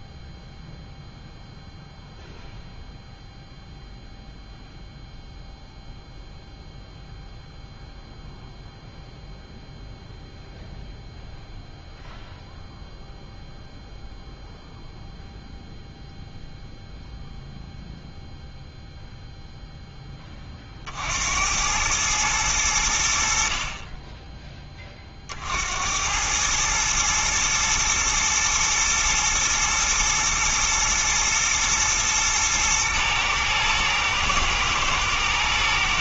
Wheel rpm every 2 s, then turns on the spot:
0, 0, 0, 0, 0, 0, 0, 0, 0, 0, 50, 90, 30, 110, 110, 110, 110, 110.
none